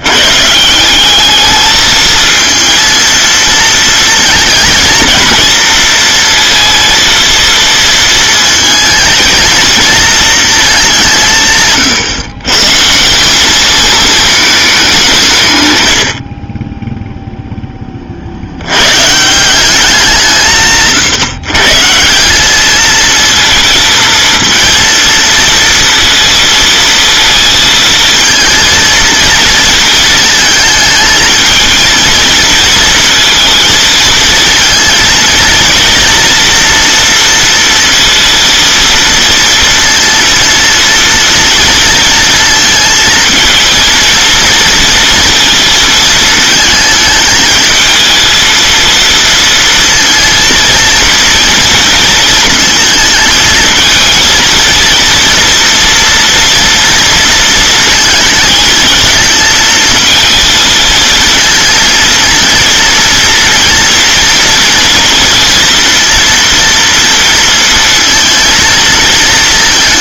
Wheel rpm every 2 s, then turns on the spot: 190, 230, 230, 230, 220, 190, 160, 190, 10, 100, 150, 220, 230, 230, 230, 220, 230, 230, 240, 230, 230, 220, 230, 220, 230, 230, 220, 230, 230, 220, 230, 230, 230, 230, 230.
none